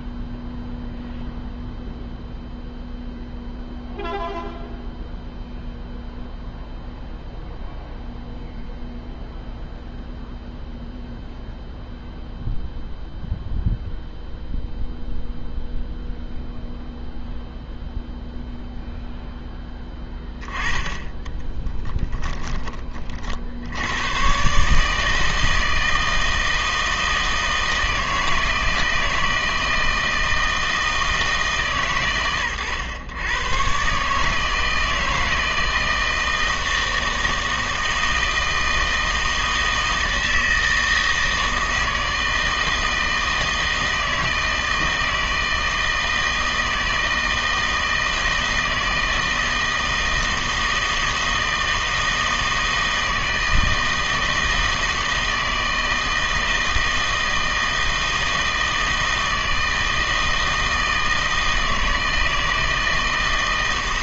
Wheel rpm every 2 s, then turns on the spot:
0, 0, 0, 0, 0, 0, 0, 0, 0, 0, 10, 20, 140, 160, 160, 160, 110, 160, 160, 160, 160, 160, 160, 160, 160, 160, 160, 160, 160, 160, 160, 160.
none